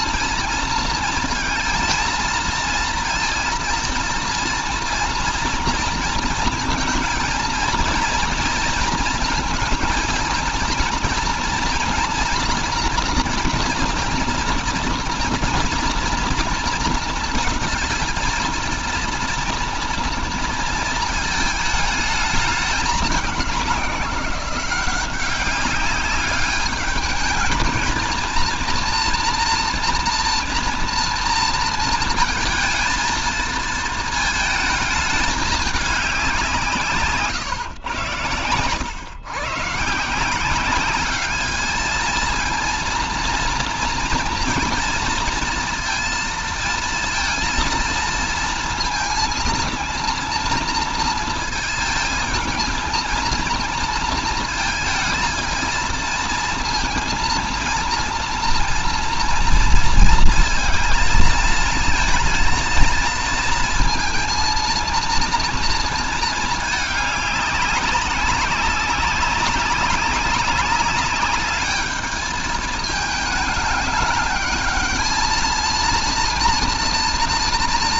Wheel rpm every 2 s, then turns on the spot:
230, 230, 230, 220, 230, 230, 230, 230, 230, 230, 230, 210, 190, 210, 230, 230, 230, 220, 160, 110, 190, 230, 230, 230, 230, 230, 220, 220, 230, 230, 230, 230, 230, 210, 200, 200, 220, 220, 230.
none